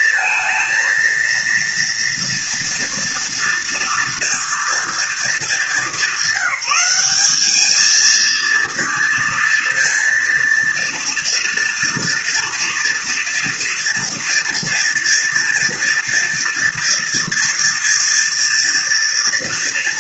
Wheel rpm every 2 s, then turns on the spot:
230, 230, 230, 200, 230, 230, 230, 230, 230, 230.
none